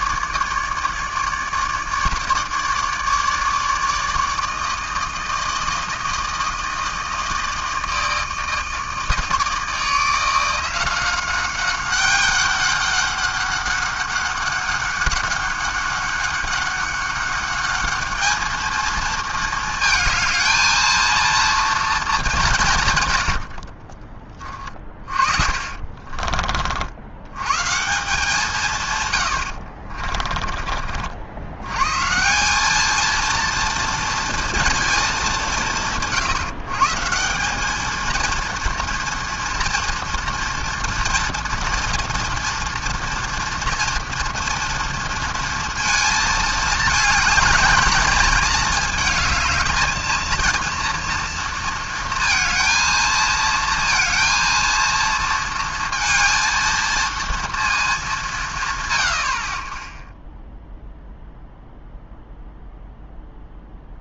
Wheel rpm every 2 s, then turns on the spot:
150, 150, 160, 160, 160, 170, 200, 200, 200, 220, 230, 160, 30, 60, 140, 40, 190, 230, 140, 230, 230, 230, 230, 220, 210, 230, 230, 230, 230, 120, 0, 0.
24-26 30-32